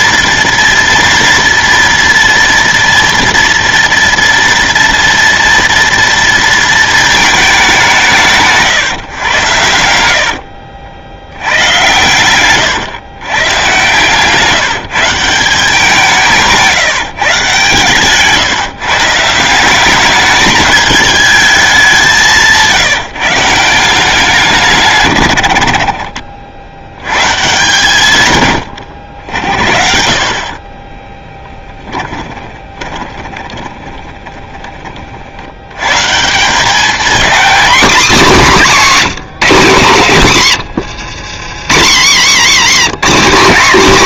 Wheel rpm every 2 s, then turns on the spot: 230, 230, 230, 220, 140, 60, 120, 170, 160, 150, 210, 170, 140, 80, 90, 30, 20, 30, 200, 210, 110, 170.
30-34 40-42